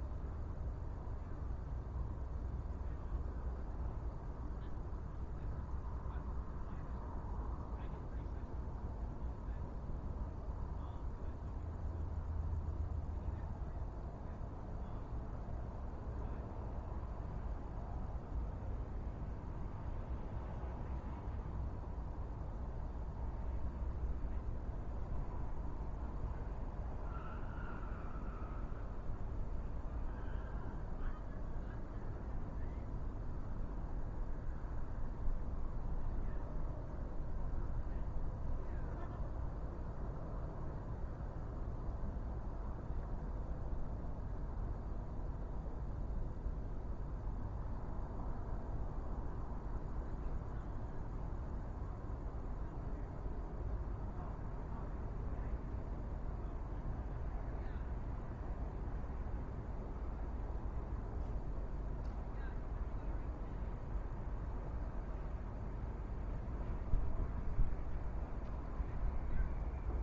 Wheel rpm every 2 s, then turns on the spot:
0, 0, 0, 0, 0, 0, 0, 0, 0, 0, 0, 0, 0, 0, 0, 0, 0, 0, 0, 0, 0, 0, 0, 0, 0, 0, 0, 0, 0, 0, 0, 0, 0, 0, 0.
none